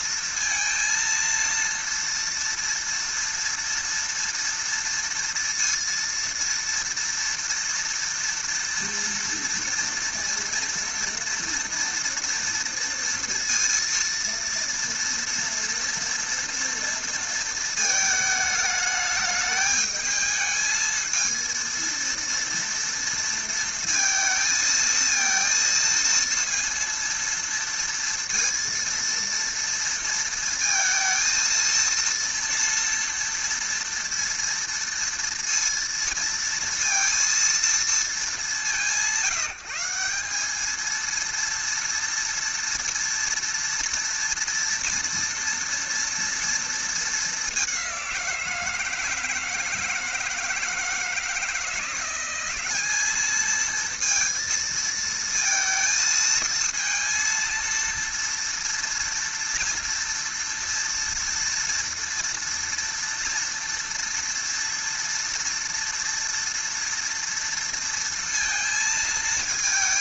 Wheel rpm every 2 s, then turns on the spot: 230, 230, 230, 230, 230, 230, 230, 230, 230, 220, 220, 230, 220, 230, 230, 230, 230, 230, 230, 180, 220, 230, 240, 230, 170, 160, 190, 230, 230, 230, 230, 230, 230, 230, 230.
none